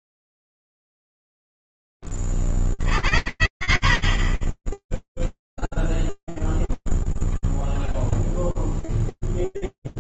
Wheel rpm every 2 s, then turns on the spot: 0, 0, 30, 0, 0.
none